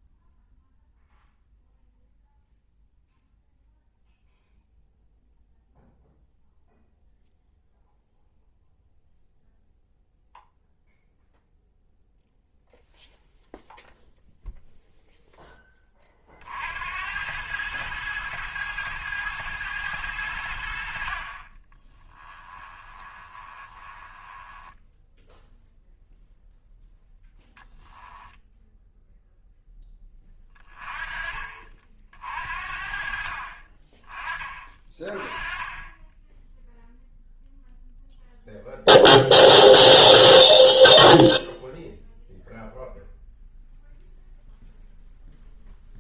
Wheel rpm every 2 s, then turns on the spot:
0, 0, 0, 0, 0, 0, 0, 0, 60, 110, 70, 20, 10, 0, 0, 20, 50, 20, 0, 0, 0, 0, 0.
22-26